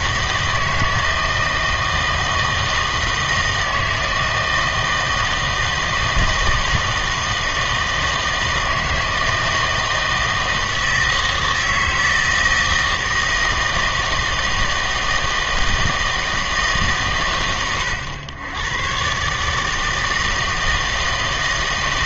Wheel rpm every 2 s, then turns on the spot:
160, 160, 160, 160, 160, 160, 160, 160, 150, 110, 160.
none